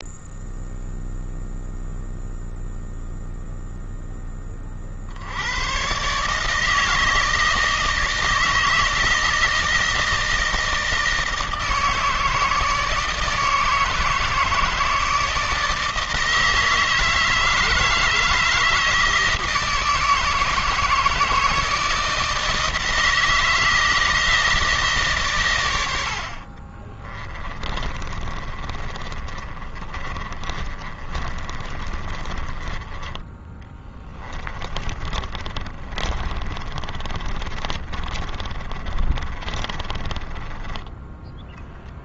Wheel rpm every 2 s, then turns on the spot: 0, 0, 70, 160, 160, 160, 160, 160, 160, 160, 160, 160, 140, 30, 40, 40, 20, 30, 30, 30, 10.
26-32 34-42